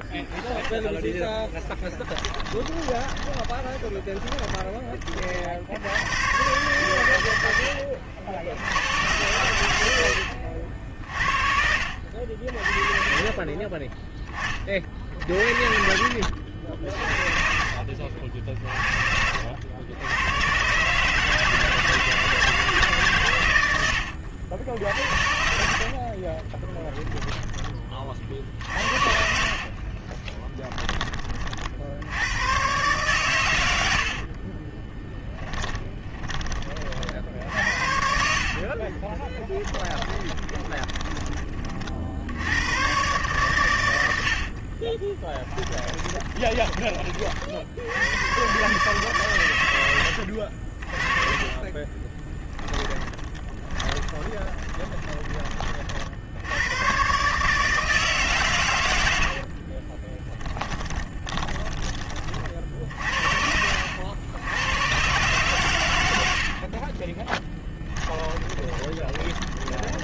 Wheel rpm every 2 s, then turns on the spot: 20, 20, 20, 110, 90, 60, 40, 30, 60, 40, 130, 160, 80, 10, 70, 20, 120, 20, 30, 40, 20, 120, 40, 20, 140, 50, 20, 20, 110, 90, 20, 50, 120, 20, 20.
2-4 10-12 26-30 34-36 38-42 44-46 50-56 60-62 66-70